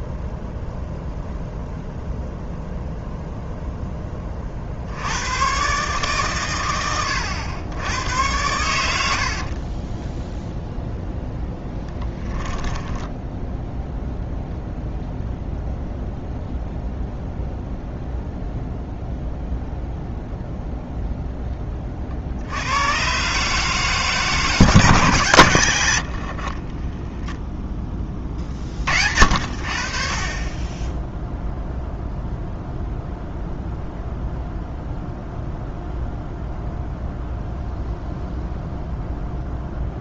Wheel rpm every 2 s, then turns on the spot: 0, 0, 20, 130, 100, 10, 10, 0, 0, 0, 0, 40, 160, 80, 20, 40, 0, 0, 0, 0.
10-14